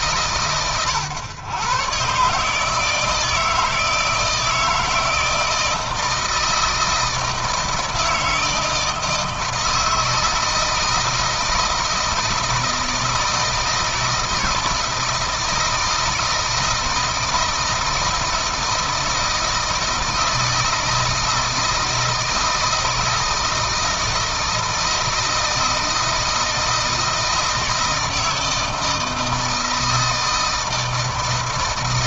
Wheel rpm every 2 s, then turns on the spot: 120, 150, 160, 160, 160, 160, 160, 160, 160, 160, 160, 160, 160, 160, 160, 160.
none